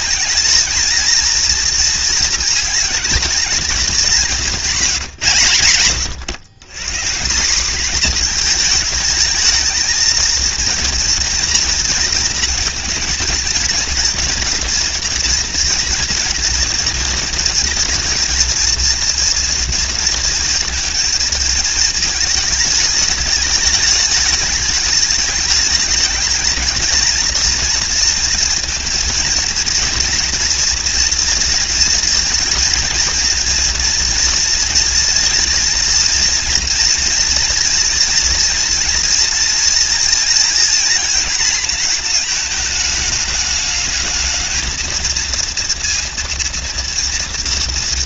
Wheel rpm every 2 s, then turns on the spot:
230, 210, 190, 160, 220, 230, 230, 230, 230, 230, 230, 210, 210, 230, 230, 230, 230, 240, 230, 240, 230, 220, 230, 230.
none